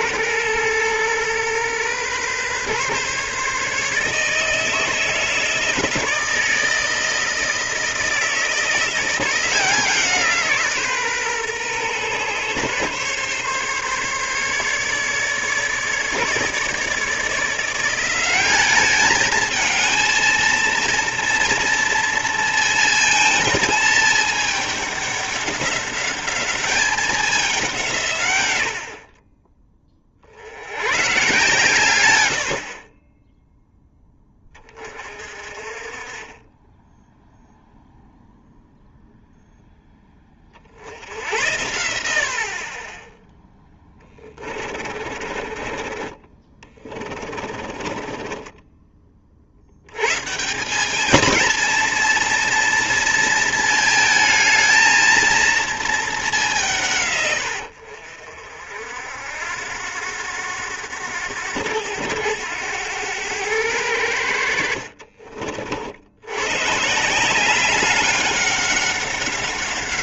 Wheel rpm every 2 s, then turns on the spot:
110, 130, 160, 160, 160, 150, 130, 140, 150, 210, 230, 230, 210, 200, 70, 110, 40, 30, 10, 0, 60, 30, 40, 20, 20, 200, 230, 220, 170, 60, 90, 100, 60, 140, 200.
44-48